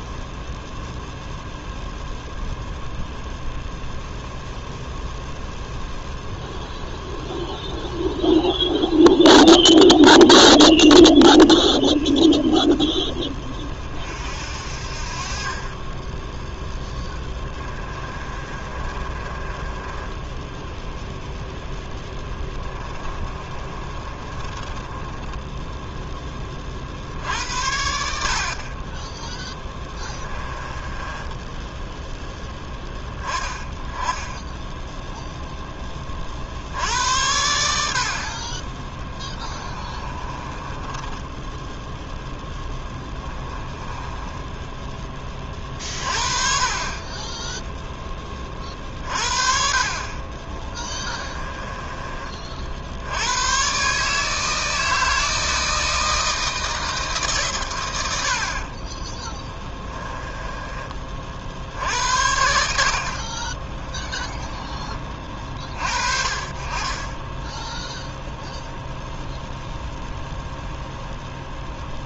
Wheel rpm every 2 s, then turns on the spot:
0, 0, 0, 0, 0, 0, 0, 60, 10, 30, 0, 20, 20, 50, 30, 20, 10, 10, 70, 20, 20, 10, 10, 40, 40, 20, 60, 160, 160, 40, 20, 70, 20, 30, 0, 0.
16-20 22-26 30-32 40-46 50-52 58-62